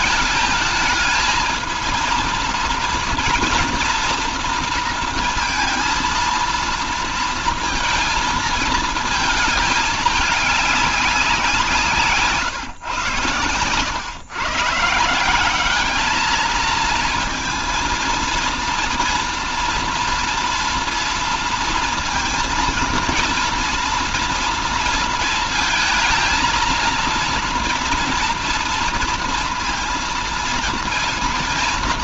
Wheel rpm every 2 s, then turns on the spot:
220, 230, 230, 230, 220, 200, 140, 150, 230, 230, 230, 230, 230, 230, 230, 230.
none